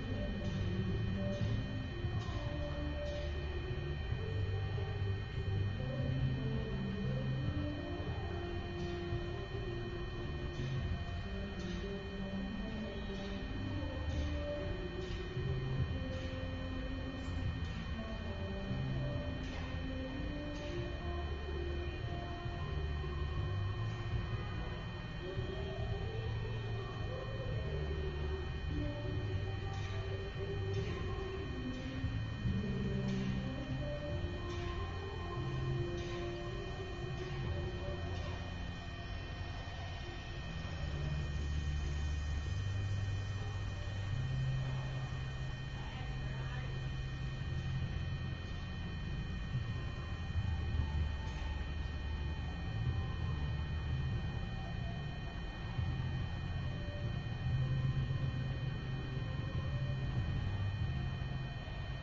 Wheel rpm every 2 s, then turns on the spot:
0, 0, 0, 0, 0, 0, 0, 0, 0, 0, 0, 0, 0, 0, 0, 0, 0, 0, 0, 0, 0, 0, 0, 0, 0, 0, 0, 0, 0, 0, 0.
none